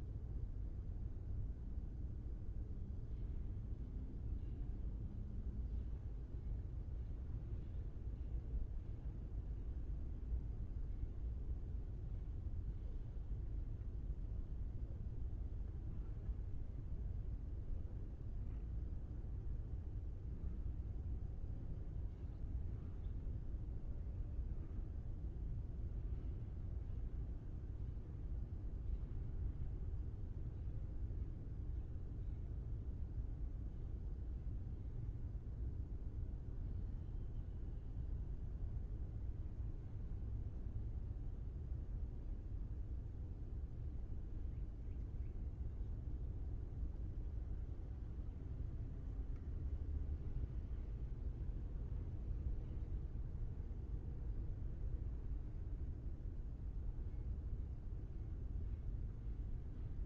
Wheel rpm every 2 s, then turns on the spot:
0, 0, 0, 0, 0, 0, 0, 0, 0, 0, 0, 0, 0, 0, 0, 0, 0, 0, 0, 0, 0, 0, 0, 0, 0, 0, 0, 0, 0, 0.
none